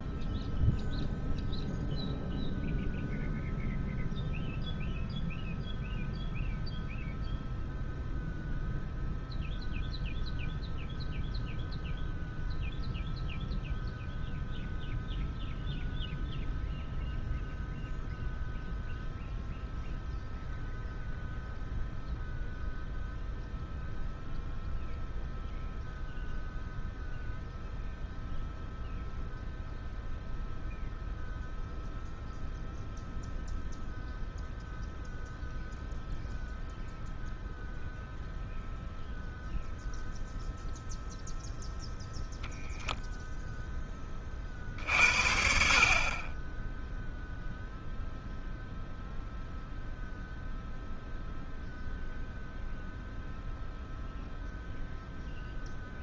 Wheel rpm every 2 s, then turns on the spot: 0, 0, 0, 0, 0, 0, 0, 0, 0, 0, 0, 0, 0, 0, 0, 0, 0, 0, 0, 0, 0, 0, 30, 30, 0, 0, 0, 0.
none